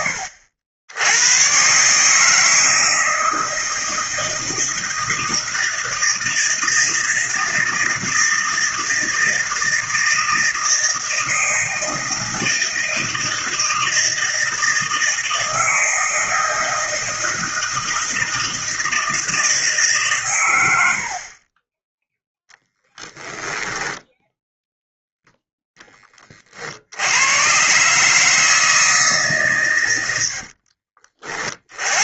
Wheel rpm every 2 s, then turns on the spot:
80, 160, 160, 160, 160, 160, 160, 160, 160, 160, 80, 10, 0, 60, 160, 50.
30-32